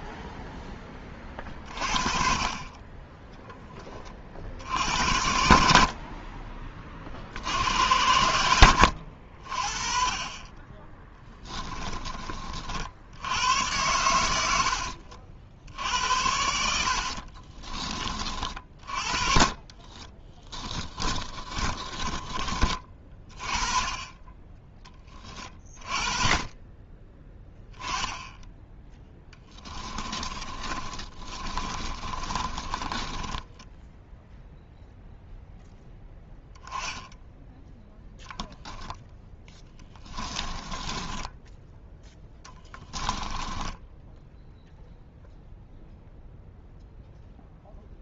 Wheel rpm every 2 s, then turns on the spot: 10, 20, 70, 30, 80, 20, 60, 70, 70, 40, 20, 30, 20, 20, 20, 30, 20, 0, 10, 0, 10, 10, 0, 0.
16-22 30-34 40-44